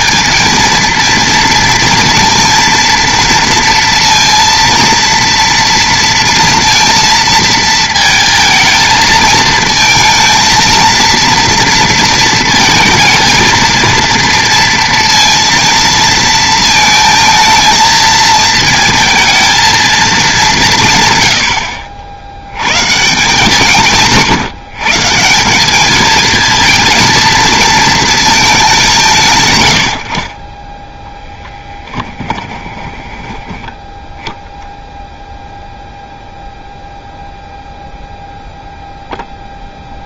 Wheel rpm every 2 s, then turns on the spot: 230, 230, 230, 230, 220, 230, 230, 230, 220, 220, 170, 120, 150, 220, 190, 10, 20, 0, 0, 0.
32-34